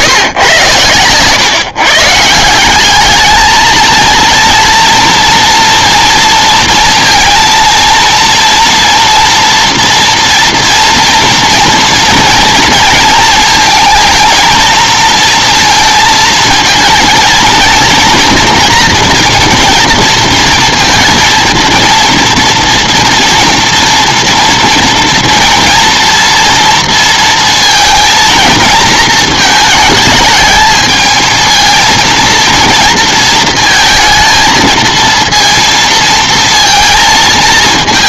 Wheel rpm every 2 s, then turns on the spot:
120, 180, 230, 230, 230, 230, 230, 230, 230, 230, 230, 230, 230, 230, 220, 220, 230, 230, 230.
none